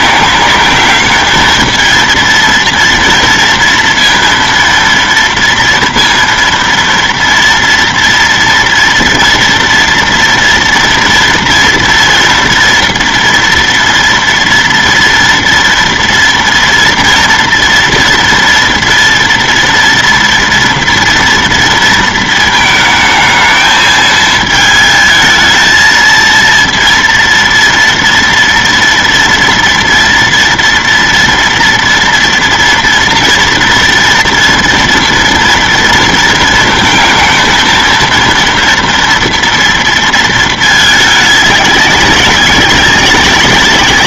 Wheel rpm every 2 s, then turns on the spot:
210, 230, 230, 230, 230, 230, 230, 230, 230, 230, 230, 220, 220, 230, 230, 240, 230, 240, 230, 230, 220, 190.
none